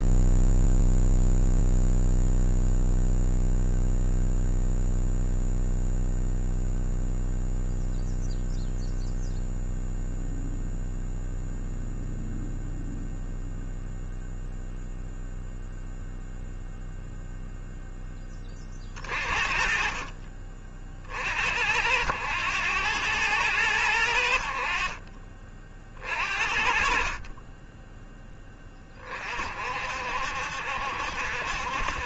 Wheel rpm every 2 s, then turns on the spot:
0, 0, 0, 0, 0, 0, 0, 0, 0, 30, 50, 100, 50, 40, 30, 70.
none